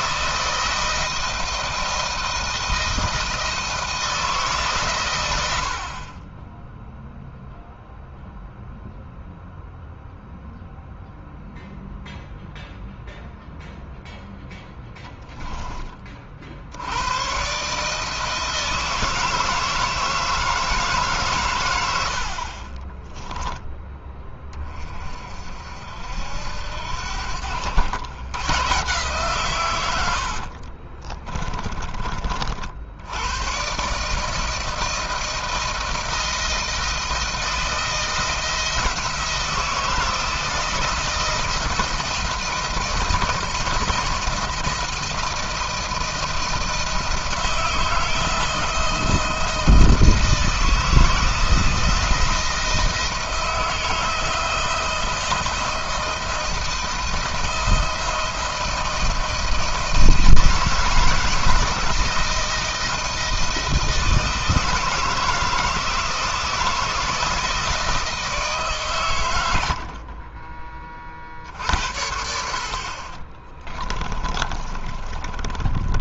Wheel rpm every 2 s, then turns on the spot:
160, 160, 150, 20, 0, 0, 0, 0, 50, 160, 160, 40, 30, 70, 130, 70, 60, 160, 160, 170, 160, 160, 170, 160, 160, 160, 170, 160, 170, 170, 160, 160, 160, 160, 150, 30, 50, 30.
30-32 74-76